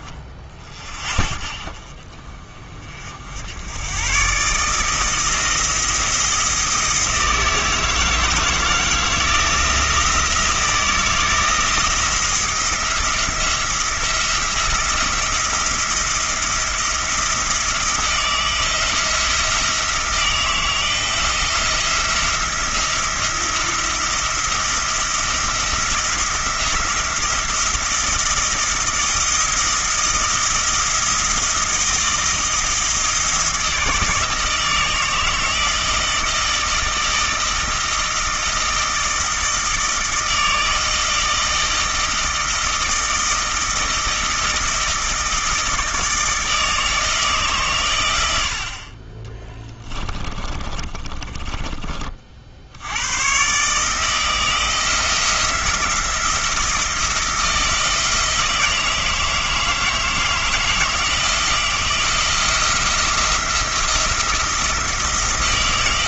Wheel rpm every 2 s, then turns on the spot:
20, 50, 160, 160, 160, 160, 170, 170, 170, 160, 160, 170, 170, 170, 170, 170, 160, 160, 160, 160, 160, 160, 160, 160, 40, 20, 90, 170, 170, 160, 160, 170, 170.
50-52